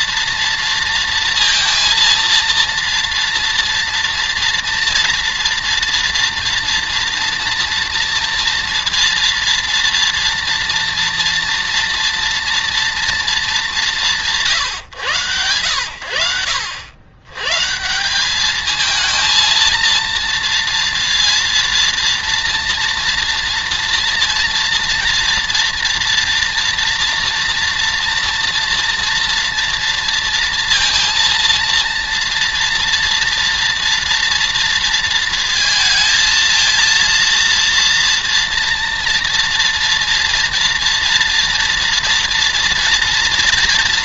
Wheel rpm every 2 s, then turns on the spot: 230, 230, 230, 240, 230, 230, 240, 160, 90, 210, 230, 230, 230, 230, 240, 230, 230, 230, 230, 230, 230, 240.
none